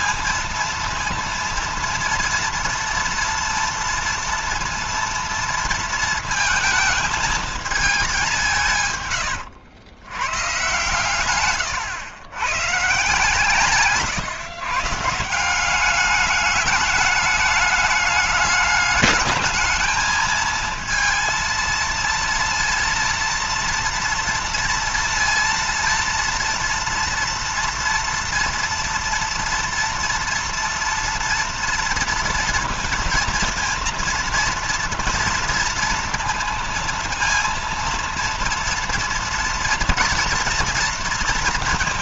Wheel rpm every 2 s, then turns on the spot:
230, 230, 230, 220, 130, 130, 140, 150, 210, 210, 230, 230, 230, 230, 230, 230, 230, 230, 230, 230, 230.
none